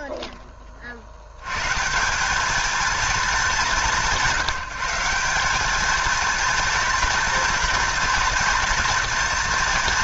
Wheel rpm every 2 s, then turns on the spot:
40, 220, 170, 230, 230.
none